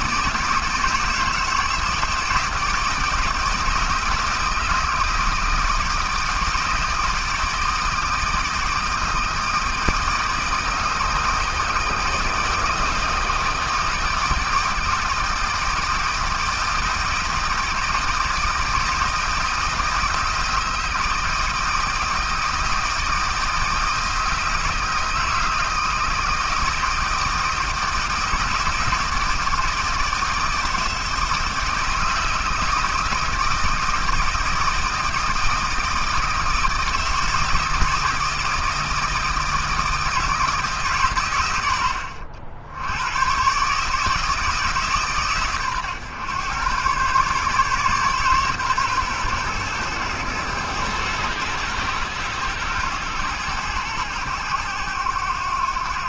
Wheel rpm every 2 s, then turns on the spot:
160, 160, 170, 160, 160, 160, 160, 160, 160, 160, 160, 160, 160, 160, 160, 160, 160, 160, 160, 160, 140, 110, 150, 130, 130, 110, 110, 100.
none